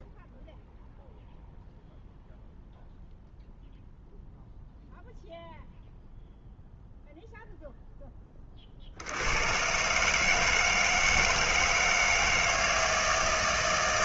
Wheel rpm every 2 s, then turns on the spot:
0, 0, 0, 0, 60, 160, 160.
none